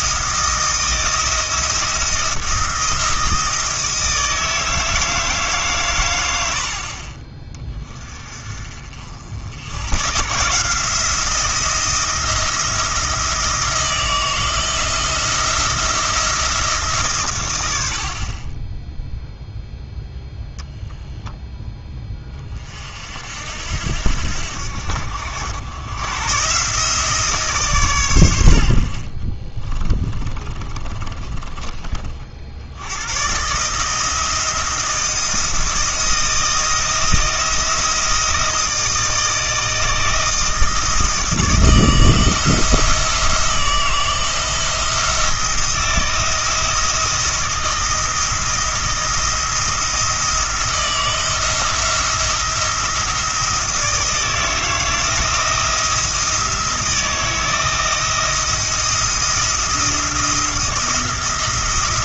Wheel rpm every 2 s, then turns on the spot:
160, 170, 160, 50, 40, 160, 170, 170, 160, 10, 0, 40, 70, 140, 70, 30, 80, 170, 160, 160, 160, 160, 170, 160, 170, 170, 170, 160, 160, 170, 170.
30-32